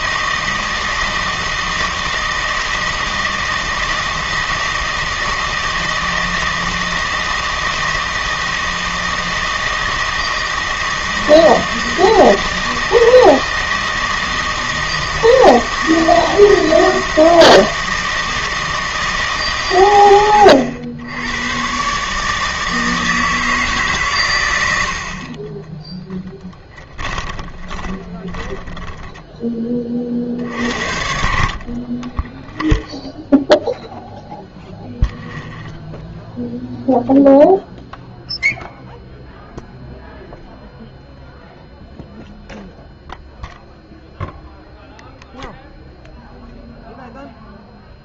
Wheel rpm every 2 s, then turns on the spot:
160, 160, 160, 160, 160, 160, 160, 160, 160, 160, 80, 160, 70, 10, 10, 60, 0, 0, 0, 0, 0, 0, 0, 0.
26-30